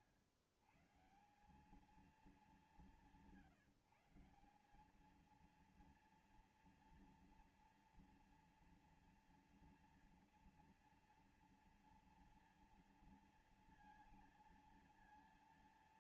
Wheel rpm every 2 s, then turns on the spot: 110, 190, 190, 230, 230, 230, 230, 230.
none